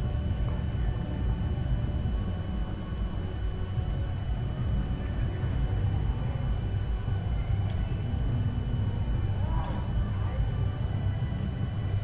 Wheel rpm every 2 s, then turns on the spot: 0, 0, 0, 0, 0, 0.
none